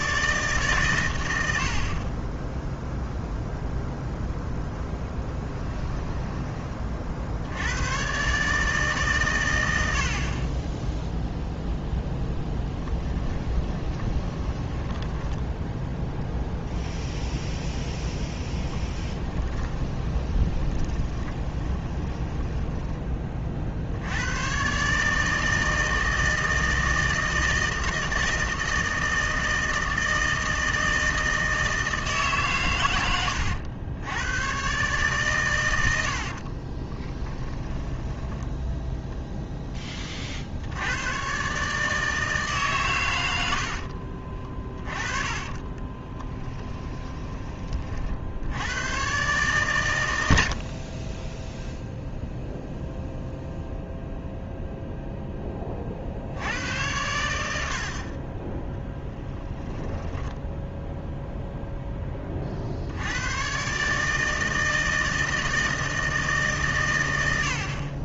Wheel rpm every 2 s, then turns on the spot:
130, 0, 10, 30, 150, 10, 10, 10, 0, 10, 20, 20, 140, 160, 160, 160, 110, 130, 30, 0, 90, 130, 20, 10, 90, 50, 0, 0, 110, 10, 10, 70, 160, 130.
12-16 20-24 36-38 44-48